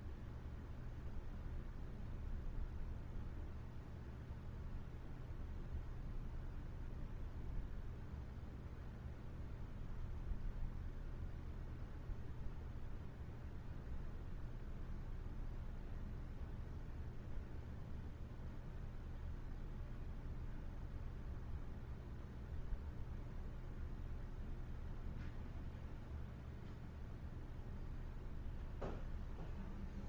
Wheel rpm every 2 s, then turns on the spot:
0, 0, 0, 0, 0, 0, 0, 0, 0, 0, 0, 0, 0, 0, 0.
none